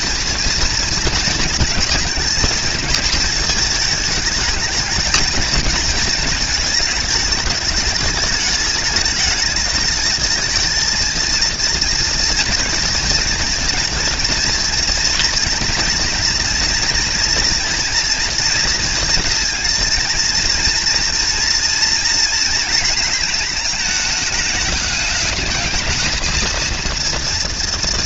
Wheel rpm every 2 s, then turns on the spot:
230, 230, 220, 220, 220, 230, 230, 230, 230, 230, 230, 230, 210, 230.
none